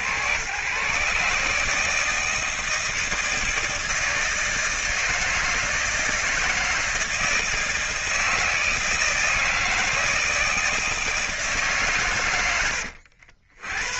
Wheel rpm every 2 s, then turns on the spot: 120, 160, 160, 160, 160, 160, 100.
none